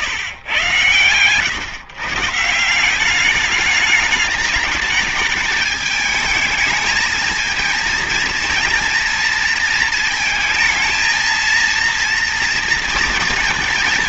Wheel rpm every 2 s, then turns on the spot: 130, 160, 210, 220, 230, 230, 230.
none